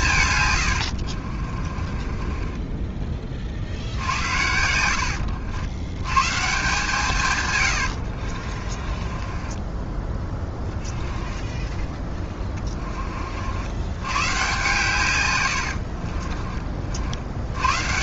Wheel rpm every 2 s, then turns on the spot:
110, 20, 70, 140, 40, 10, 20, 130, 40.
0-4 8-12